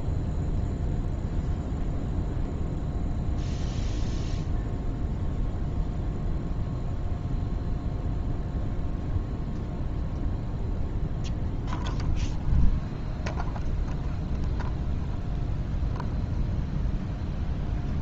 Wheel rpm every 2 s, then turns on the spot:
0, 0, 0, 0, 0, 0, 0, 0, 0.
none